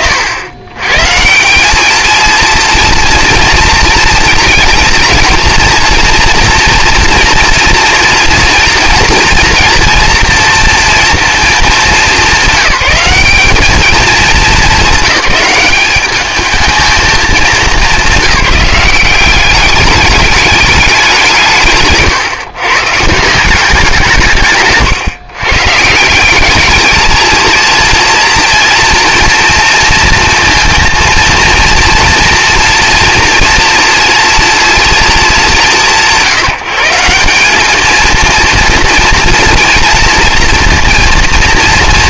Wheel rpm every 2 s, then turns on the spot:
100, 230, 230, 230, 230, 230, 200, 190, 220, 180, 210, 140, 150, 200, 230, 230, 230, 230, 170, 240, 230.
none